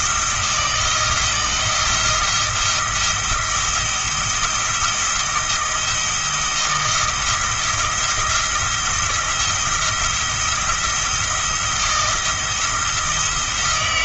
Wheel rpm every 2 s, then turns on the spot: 160, 170, 170, 170, 170, 170, 170.
none